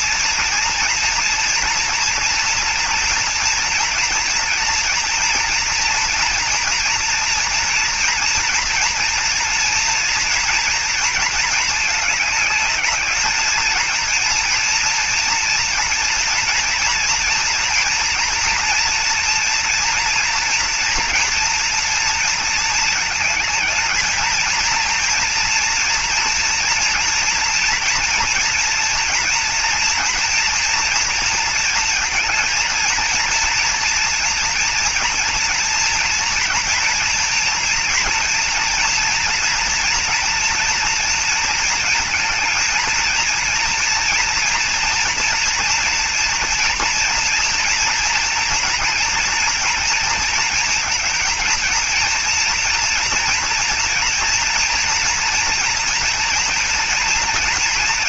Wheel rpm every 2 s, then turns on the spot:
230, 230, 230, 230, 230, 230, 210, 230, 230, 230, 230, 230, 220, 230, 230, 230, 230, 240, 230, 230, 240, 220, 230, 230, 230, 230, 230, 230, 230.
none